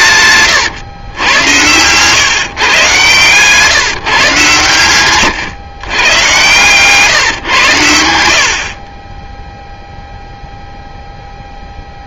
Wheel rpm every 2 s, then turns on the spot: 130, 140, 130, 120, 50, 0.
0-2